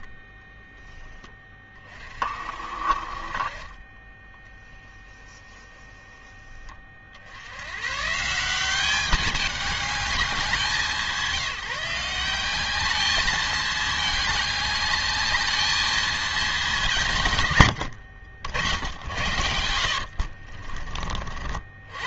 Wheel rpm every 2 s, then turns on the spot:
40, 20, 10, 110, 200, 170, 210, 220, 100, 70, 110.
2-6 16-20